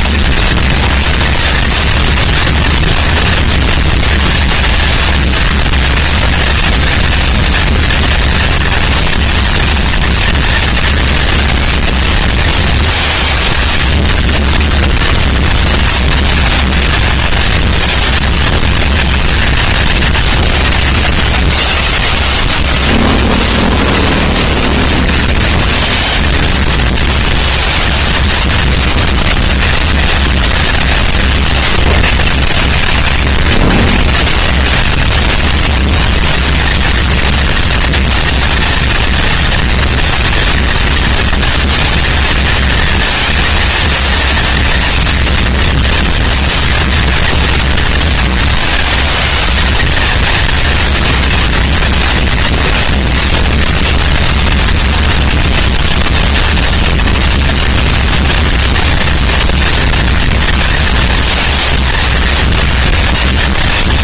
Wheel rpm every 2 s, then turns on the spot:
230, 230, 230, 230, 230, 230, 230, 230, 230, 220, 210, 160, 190, 220, 220, 190, 120, 140, 210, 240, 230, 230, 230, 230, 230, 230, 230, 240, 230, 230, 230, 230.
none